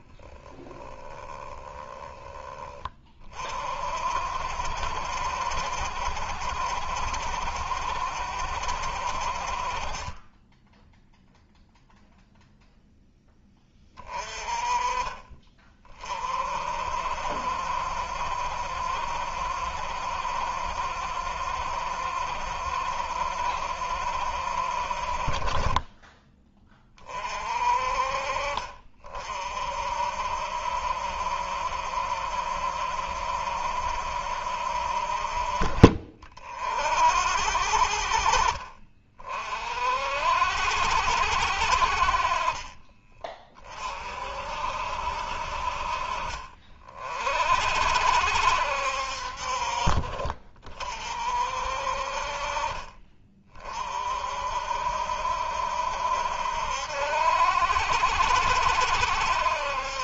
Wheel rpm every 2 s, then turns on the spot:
10, 10, 60, 70, 70, 20, 0, 30, 50, 70, 70, 70, 60, 20, 50, 60, 70, 60, 40, 40, 70, 30, 60, 40, 70, 40, 40, 50, 70, 70.
0-2 10-12